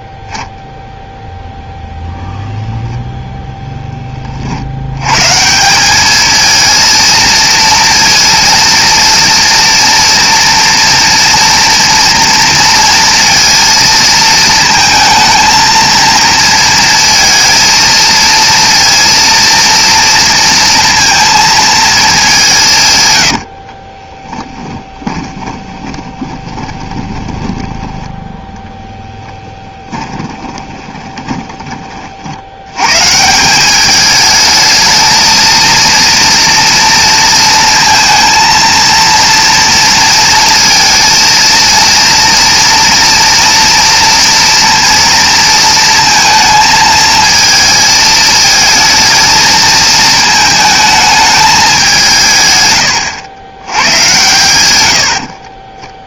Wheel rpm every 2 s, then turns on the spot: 0, 10, 80, 220, 230, 230, 230, 230, 230, 230, 230, 160, 20, 20, 20, 20, 100, 210, 230, 230, 230, 240, 230, 220, 220, 220, 120, 90.
24-28 30-32